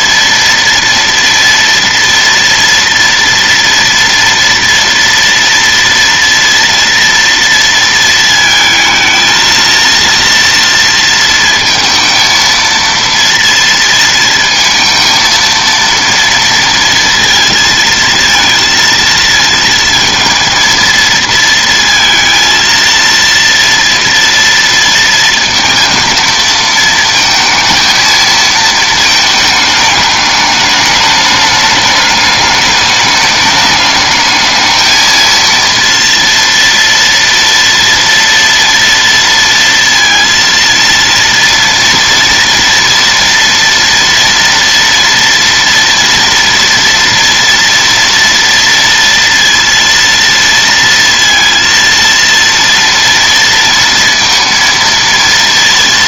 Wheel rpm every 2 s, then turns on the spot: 230, 230, 230, 230, 220, 230, 230, 230, 230, 230, 230, 230, 230, 220, 220, 210, 210, 220, 230, 230, 230, 240, 230, 230, 230, 230, 230, 230.
none